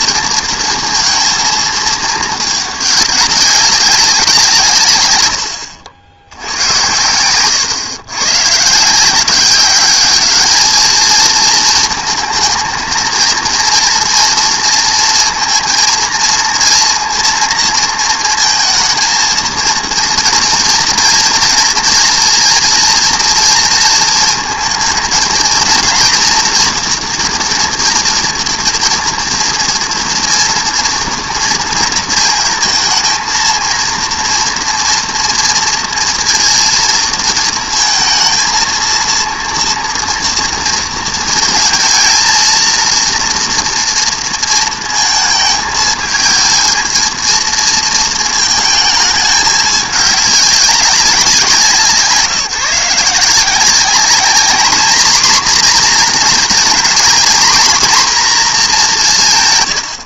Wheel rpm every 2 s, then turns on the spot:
230, 210, 120, 110, 170, 220, 230, 230, 230, 220, 230, 240, 230, 230, 230, 230, 220, 230, 230, 230, 230, 230, 220, 220, 220, 190, 170, 240, 240, 200.
none